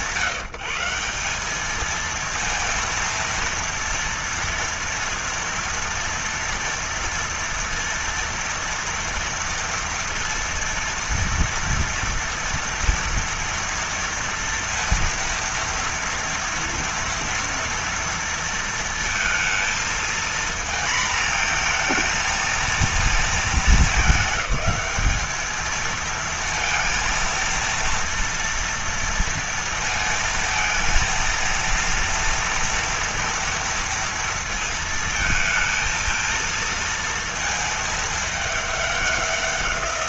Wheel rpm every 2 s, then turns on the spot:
170, 230, 230, 230, 230, 230, 230, 230, 230, 230, 230, 230, 210, 230, 230, 230, 240, 230, 230, 210.
none